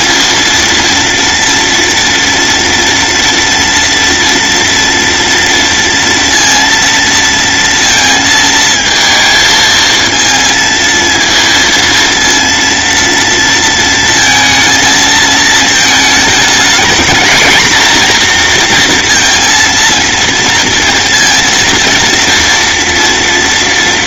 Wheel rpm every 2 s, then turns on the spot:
230, 230, 230, 230, 220, 230, 230, 230, 230, 240, 230, 240.
none